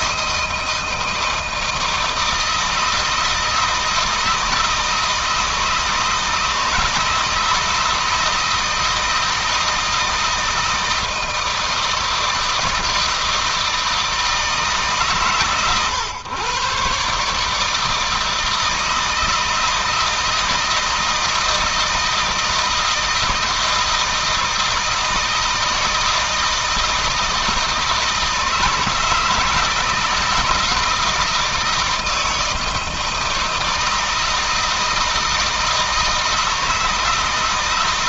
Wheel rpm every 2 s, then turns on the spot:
160, 160, 160, 160, 160, 160, 160, 140, 140, 160, 160, 160, 160, 160, 160, 160, 160, 160, 160.
none